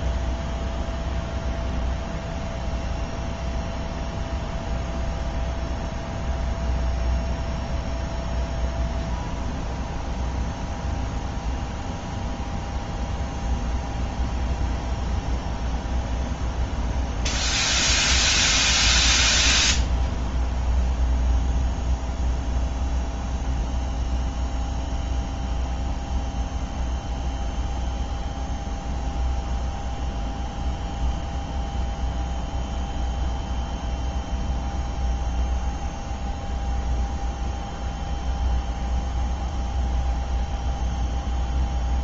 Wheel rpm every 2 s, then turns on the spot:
0, 0, 0, 0, 0, 0, 0, 0, 0, 0, 0, 0, 0, 0, 0, 0, 0, 0, 0, 0, 0.
none